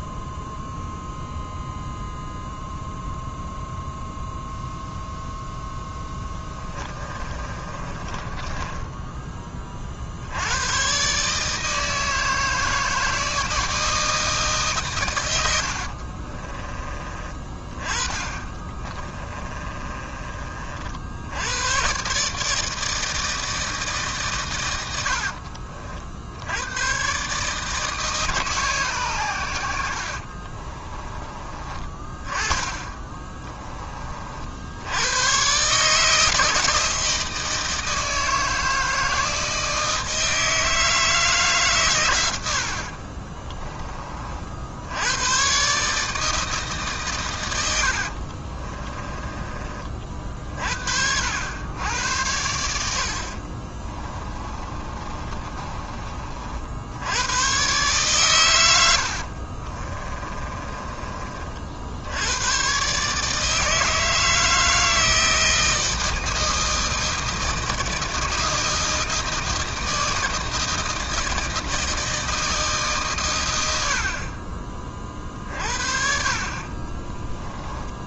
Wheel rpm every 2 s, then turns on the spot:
0, 0, 0, 20, 10, 120, 160, 130, 20, 30, 60, 160, 100, 110, 130, 30, 20, 90, 160, 160, 160, 50, 80, 150, 30, 60, 70, 30, 80, 90, 30, 130, 160, 160, 160, 160, 140, 40, 20.
6-10 18-20 32-34 42-44 48-50 54-56 58-60 76-78